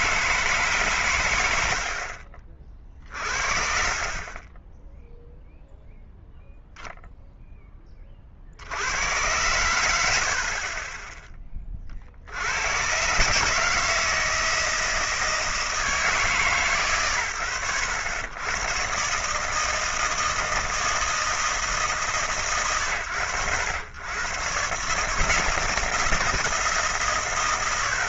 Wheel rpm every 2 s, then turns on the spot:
90, 30, 0, 10, 90, 30, 150, 150, 100, 160, 160, 100, 160, 100.
none